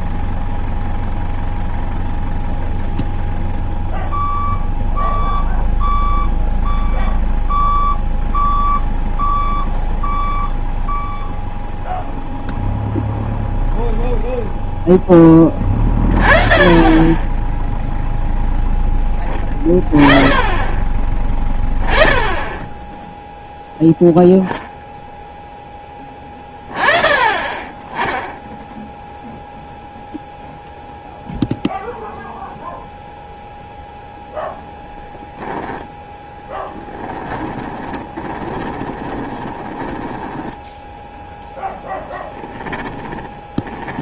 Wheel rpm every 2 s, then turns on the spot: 0, 0, 0, 0, 0, 0, 0, 0, 20, 0, 20, 10, 0, 20, 10, 0, 0, 0, 10, 20, 10, 10.
36-40 42-44